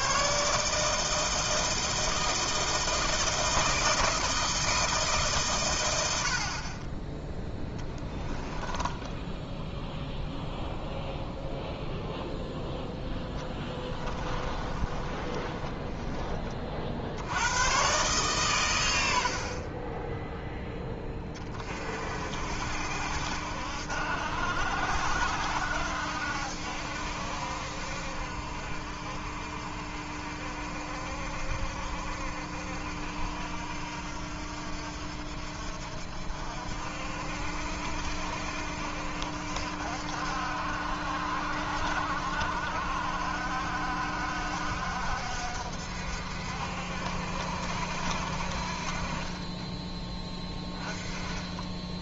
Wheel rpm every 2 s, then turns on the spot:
160, 160, 160, 30, 10, 0, 0, 30, 60, 90, 20, 70, 70, 70, 60, 50, 60, 60, 60, 60, 60, 60, 60, 60, 40, 10.
8-10 14-16 50-52